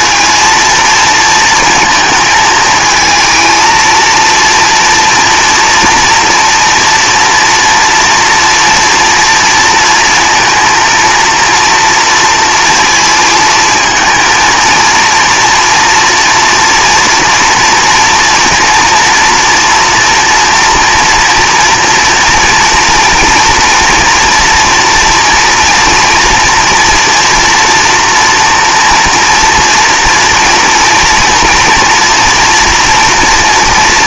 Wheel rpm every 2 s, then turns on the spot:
230, 220, 230, 230, 230, 230, 230, 220, 230, 230, 230, 230, 230, 230, 240, 240, 240.
none